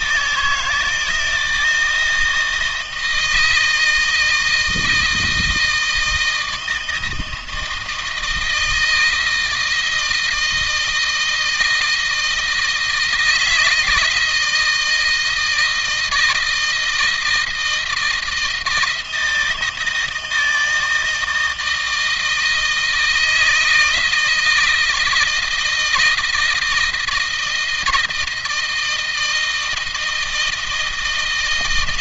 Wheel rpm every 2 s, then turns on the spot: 160, 160, 160, 160, 160, 160, 160, 160, 160, 160, 160, 160, 160, 170, 160, 160.
none